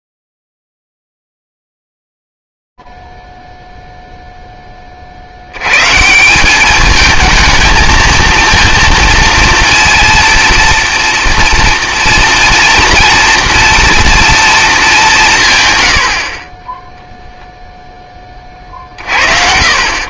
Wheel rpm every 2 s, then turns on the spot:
0, 0, 0, 170, 230, 230, 230, 230, 70, 30.
none